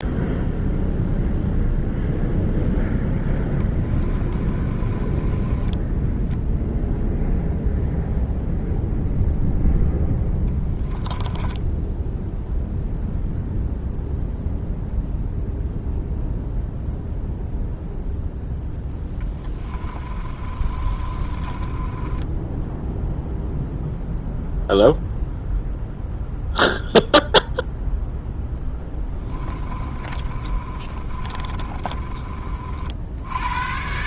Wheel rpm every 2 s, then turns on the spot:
0, 0, 20, 0, 0, 10, 0, 0, 0, 0, 30, 0, 0, 0, 10, 30, 60.
4-6 10-12 20-22 28-32